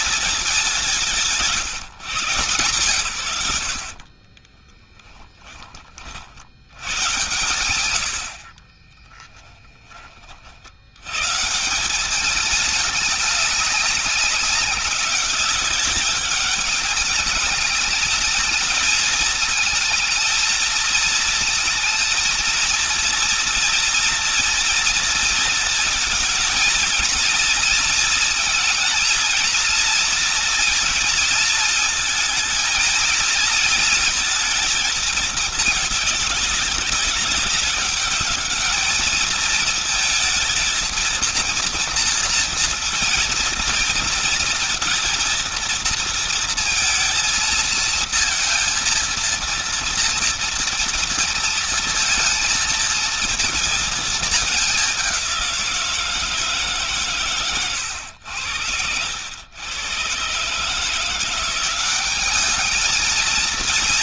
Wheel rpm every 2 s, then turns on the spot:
200, 130, 20, 90, 40, 70, 210, 200, 200, 220, 220, 230, 230, 230, 230, 230, 230, 220, 200, 210, 220, 230, 240, 230, 230, 230, 230, 200, 160, 90, 150, 210.
4-6 8-10